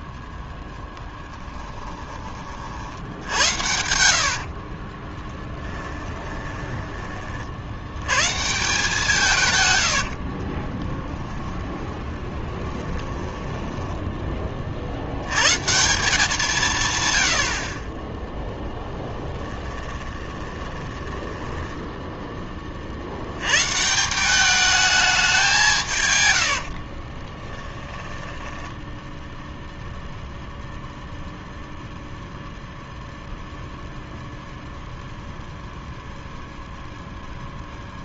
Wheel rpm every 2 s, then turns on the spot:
10, 50, 40, 20, 170, 20, 20, 40, 170, 10, 20, 40, 210, 70, 10, 0, 0, 0, 0.
4-8 10-14 18-22 26-30